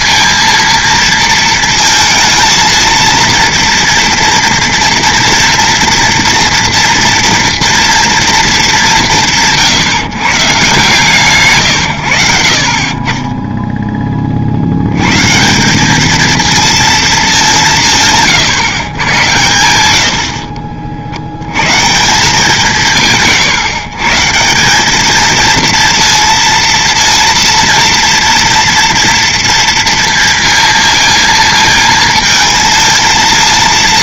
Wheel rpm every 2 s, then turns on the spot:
230, 230, 230, 230, 210, 150, 60, 70, 230, 140, 50, 180, 180, 230, 230, 230, 230.
20-22